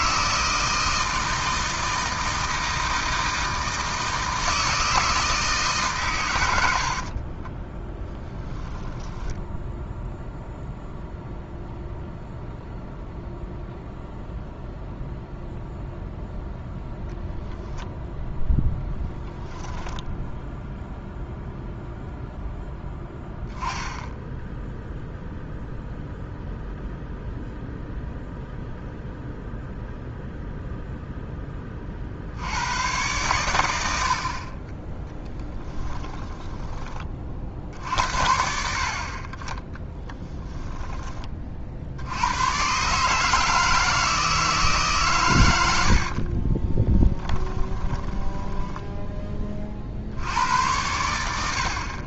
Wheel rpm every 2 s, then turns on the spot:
160, 160, 160, 70, 10, 0, 0, 0, 0, 10, 0, 0, 0, 0, 0, 0, 100, 20, 20, 60, 10, 130, 150, 30, 10, 90.
8-10 18-20 40-42 46-50